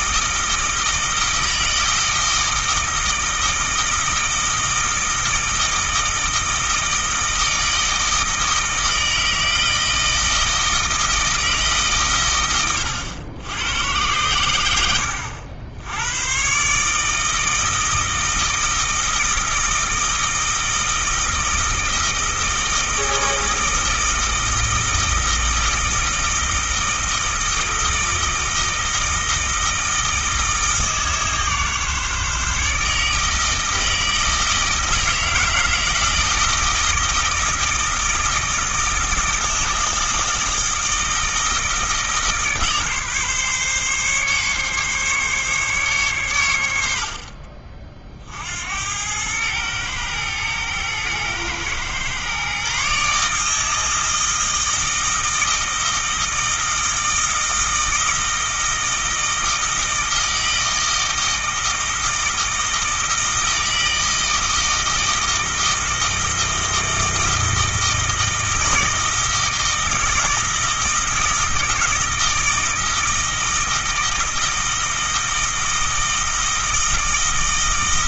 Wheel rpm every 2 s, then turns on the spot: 160, 160, 160, 160, 160, 160, 100, 90, 140, 160, 160, 160, 160, 160, 160, 160, 150, 160, 160, 160, 160, 150, 140, 80, 80, 110, 140, 160, 160, 160, 160, 160, 160, 160, 160, 160, 160, 160, 160.
none